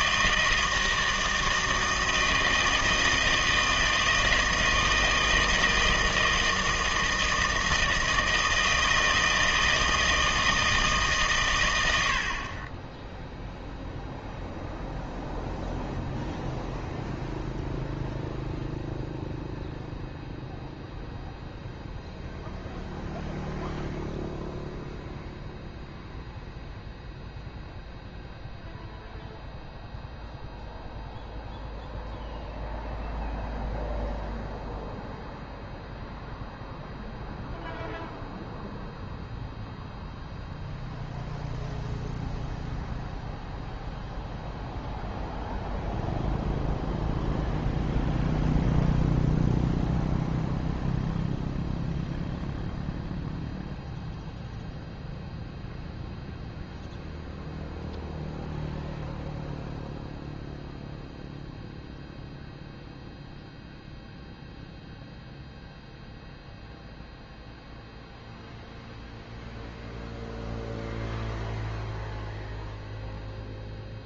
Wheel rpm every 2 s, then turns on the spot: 160, 160, 160, 160, 160, 160, 20, 0, 0, 0, 0, 0, 0, 0, 0, 0, 0, 0, 0, 0, 0, 0, 0, 0, 0, 0, 0, 0, 0, 0, 0, 0, 0, 0, 0, 0, 0.
none